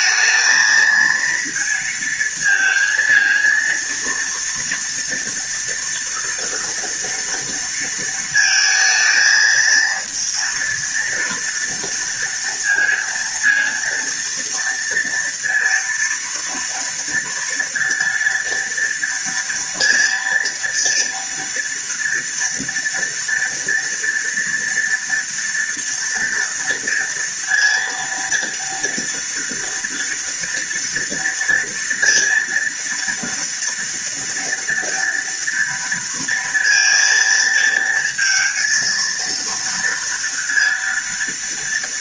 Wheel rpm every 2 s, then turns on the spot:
230, 230, 230, 230, 220, 230, 230, 230, 230, 230, 230, 230, 230, 230, 230, 230, 230, 230, 230, 230, 210.
none